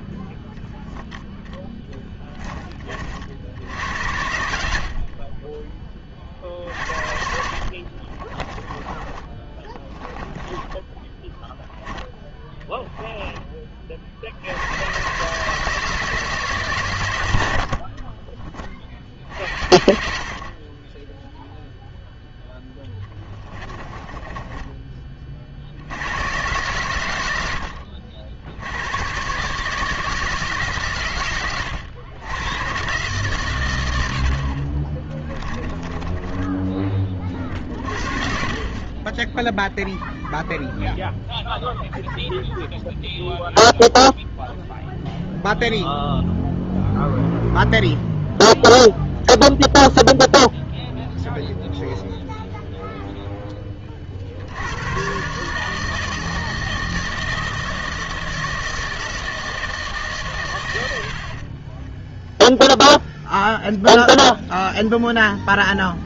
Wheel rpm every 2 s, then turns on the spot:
0, 20, 50, 50, 20, 10, 10, 80, 140, 30, 40, 10, 20, 110, 80, 150, 110, 40, 20, 40, 0, 0, 0, 0, 0, 0, 0, 90, 160, 160, 110, 0, 0.
6-14 22-26 34-38